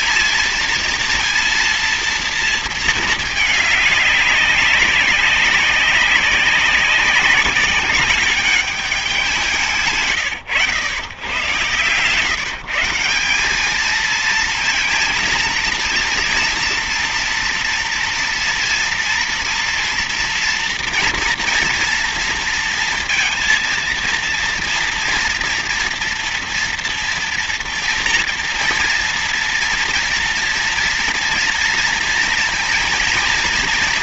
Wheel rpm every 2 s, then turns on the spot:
230, 220, 200, 190, 200, 130, 160, 220, 230, 230, 230, 230, 230, 240, 230, 240, 230.
none